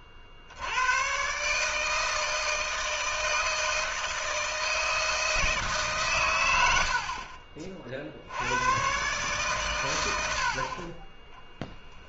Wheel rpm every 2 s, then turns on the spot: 70, 160, 160, 100, 100, 50.
none